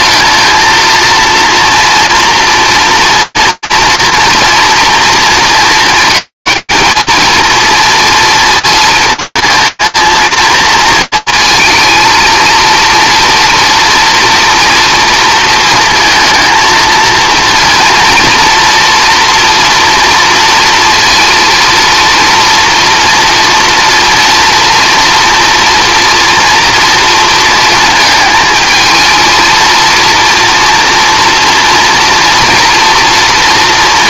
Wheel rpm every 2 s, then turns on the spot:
220, 230, 240, 220, 230, 230, 230, 230, 230, 230, 230, 230, 230, 230, 220, 230, 230.
none